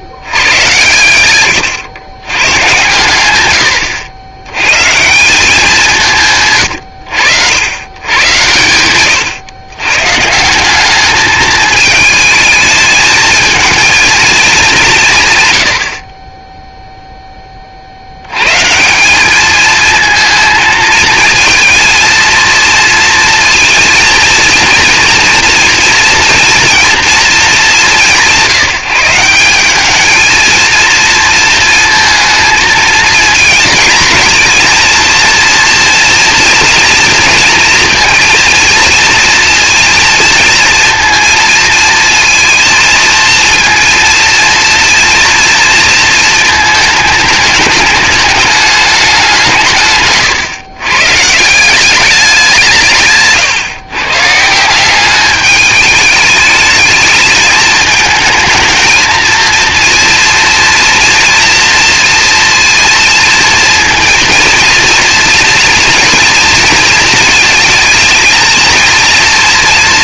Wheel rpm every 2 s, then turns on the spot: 100, 130, 130, 120, 110, 190, 220, 190, 0, 140, 220, 230, 230, 230, 160, 230, 220, 220, 230, 230, 230, 230, 230, 220, 210, 130, 170, 170, 210, 220, 230, 230, 230, 230, 230.
none